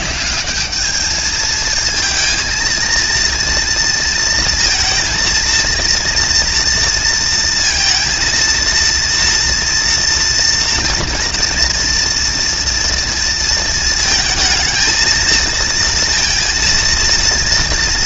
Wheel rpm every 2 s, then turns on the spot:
210, 220, 230, 230, 230, 230, 230, 220, 230.
none